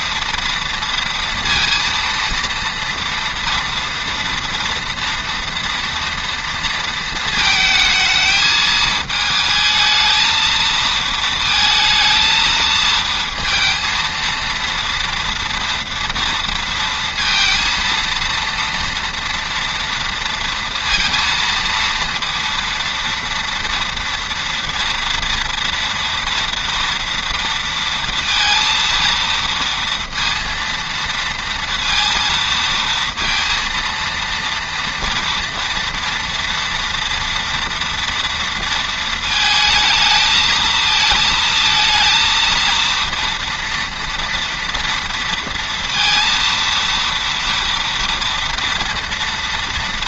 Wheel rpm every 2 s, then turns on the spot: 230, 230, 230, 230, 220, 220, 220, 230, 230, 230, 230, 230, 230, 230, 230, 230, 230, 230, 230, 230, 220, 230, 230, 230, 230.
none